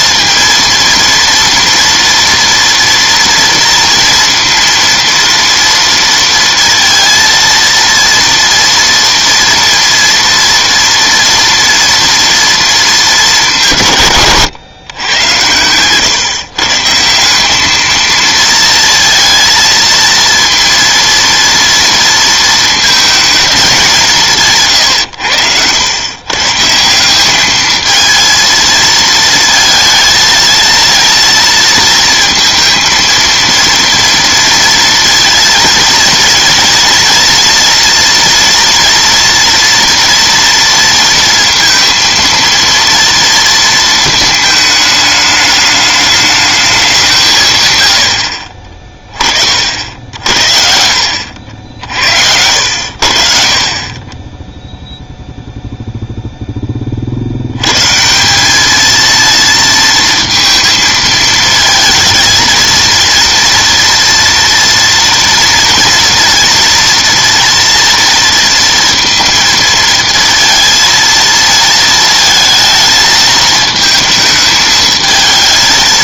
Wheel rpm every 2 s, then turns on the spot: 230, 240, 230, 230, 230, 230, 230, 130, 140, 230, 230, 230, 150, 140, 230, 230, 230, 230, 230, 240, 230, 230, 220, 210, 50, 60, 80, 10, 10, 190, 230, 230, 230, 230, 230, 230, 220, 220.
50-52